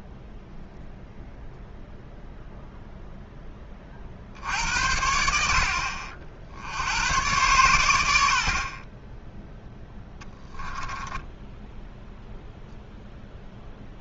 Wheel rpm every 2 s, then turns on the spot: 0, 0, 70, 70, 40, 10, 0.
10-12